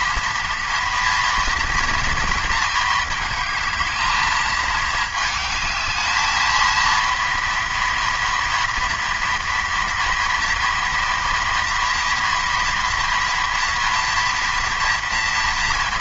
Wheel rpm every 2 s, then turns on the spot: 230, 220, 210, 230, 230, 230, 230, 230.
none